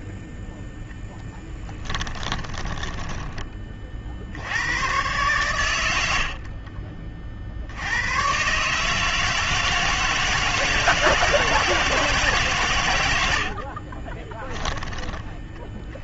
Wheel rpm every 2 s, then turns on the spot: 10, 10, 110, 40, 150, 160, 110, 10.
0-4 14-16